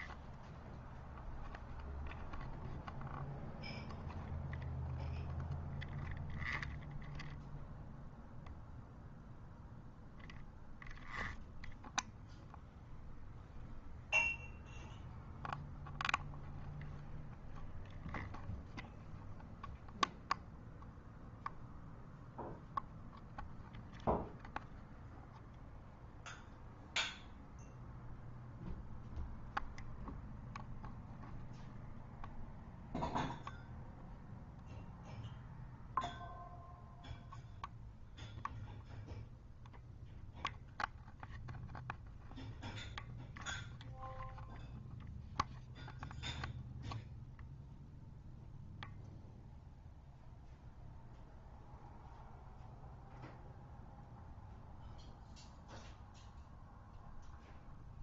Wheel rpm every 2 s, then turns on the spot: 0, 0, 0, 0, 0, 0, 0, 0, 0, 0, 0, 0, 0, 0, 0, 0, 0, 0, 0, 0, 0, 0, 0, 0, 0, 0, 0, 0, 0.
none